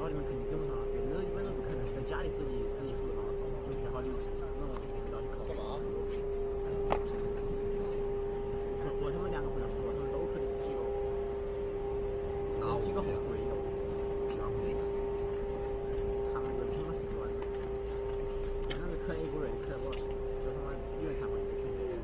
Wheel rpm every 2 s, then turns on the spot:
0, 0, 0, 0, 0, 0, 0, 0, 0, 0, 0.
none